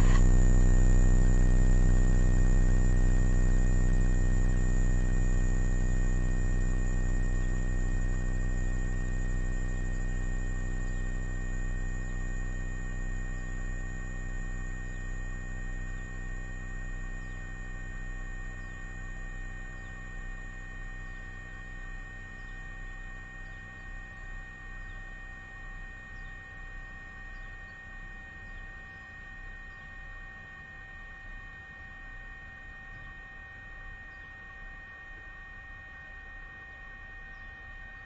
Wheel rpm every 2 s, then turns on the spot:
0, 0, 0, 0, 0, 0, 0, 0, 0, 0, 0, 0, 0, 0, 0, 0, 0, 0, 0.
none